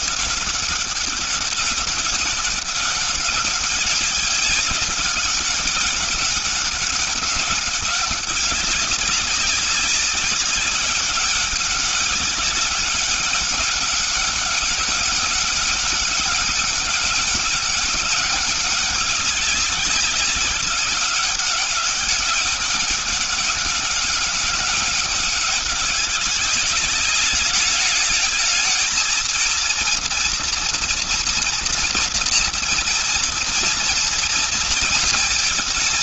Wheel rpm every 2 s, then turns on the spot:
200, 190, 200, 200, 200, 190, 200, 200, 200, 200, 190, 200, 190, 200, 220, 230, 240, 230.
none